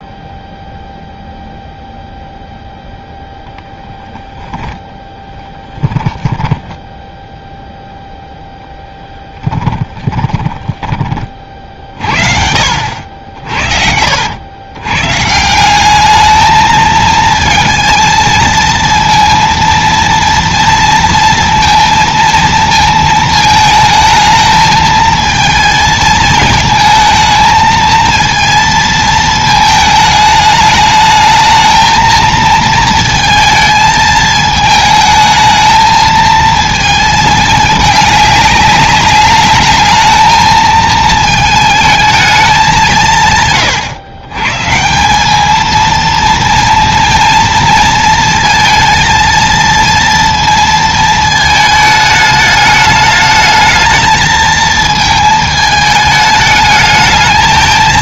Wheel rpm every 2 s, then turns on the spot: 0, 0, 10, 10, 10, 30, 60, 110, 220, 230, 230, 220, 220, 220, 220, 210, 230, 220, 220, 200, 220, 190, 170, 230, 220, 220, 210, 220, 210.
6-8 10-12